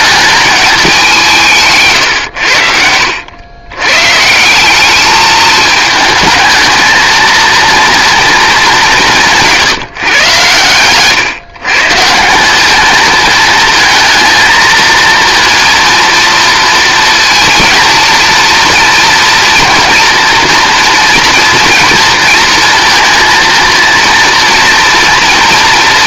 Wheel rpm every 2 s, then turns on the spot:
200, 90, 200, 220, 210, 110, 200, 220, 230, 230, 240, 230, 230.
2-4